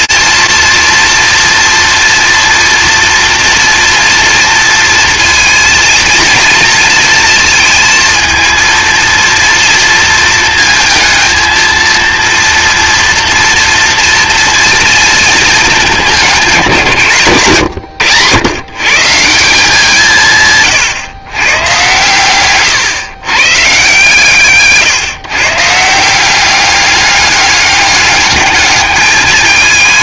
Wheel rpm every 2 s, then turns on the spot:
230, 240, 230, 230, 230, 230, 230, 230, 170, 120, 150, 130, 150, 200, 210.
none